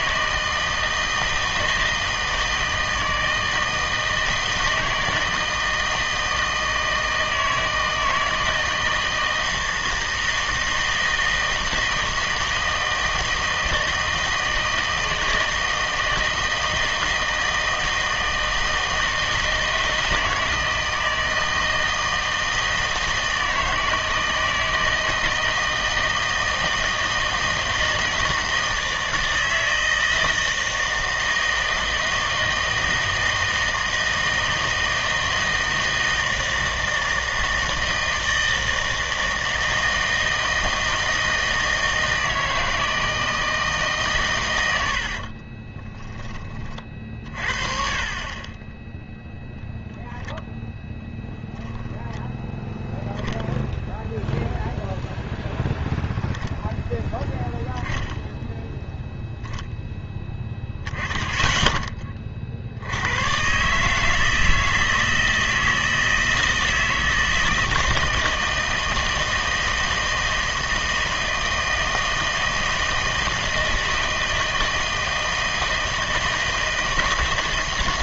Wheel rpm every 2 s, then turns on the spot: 160, 160, 160, 160, 160, 160, 160, 160, 160, 160, 160, 160, 160, 160, 160, 160, 160, 160, 160, 160, 160, 160, 100, 30, 20, 0, 0, 0, 0, 0, 10, 60, 160, 160, 160, 160, 160, 160, 160.
none